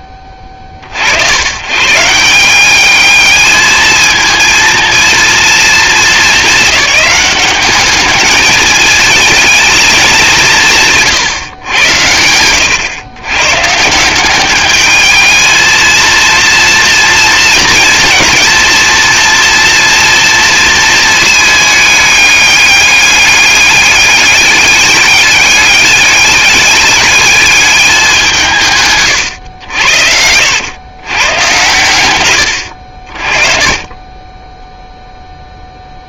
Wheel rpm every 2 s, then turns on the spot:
40, 210, 230, 210, 210, 150, 110, 220, 230, 230, 220, 200, 200, 210, 130, 120, 50, 0.
28-30